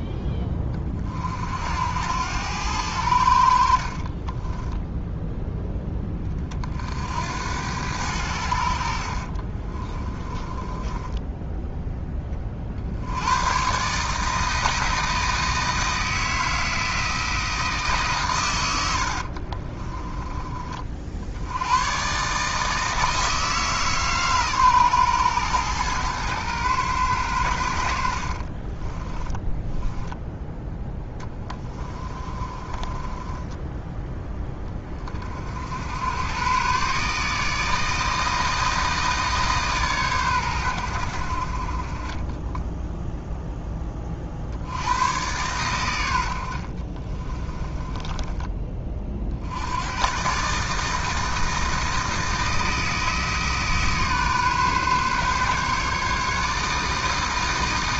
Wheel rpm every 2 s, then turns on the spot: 20, 90, 10, 60, 60, 20, 60, 160, 160, 90, 40, 160, 120, 110, 30, 10, 20, 30, 140, 160, 100, 10, 80, 50, 30, 150, 160, 140, 160.
4-6 10-12 18-20 28-30 32-34 46-48